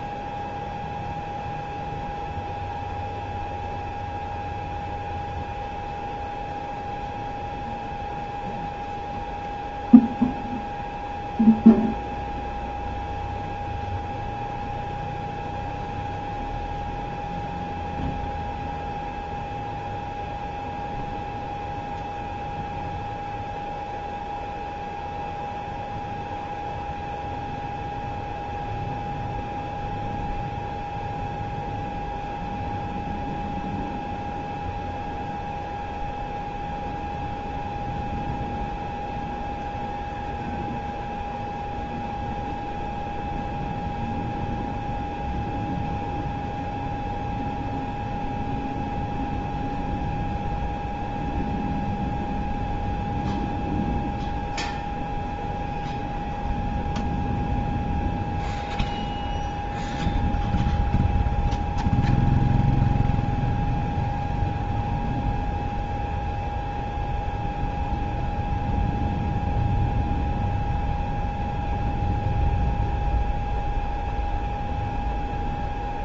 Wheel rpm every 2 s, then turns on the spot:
0, 0, 0, 0, 0, 0, 0, 0, 0, 0, 0, 0, 0, 0, 0, 0, 0, 0, 0, 0, 0, 0, 0, 0, 0, 0, 0, 0, 0, 0, 0, 0, 0, 0, 0, 0, 0, 0.
none